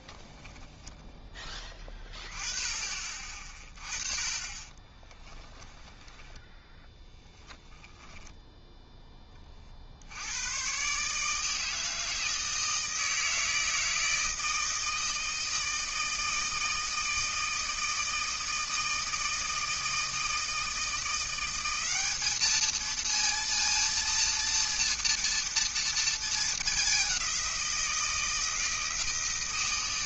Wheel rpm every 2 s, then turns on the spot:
10, 30, 20, 10, 0, 120, 160, 160, 160, 160, 160, 220, 230, 210, 160.
0-2 4-8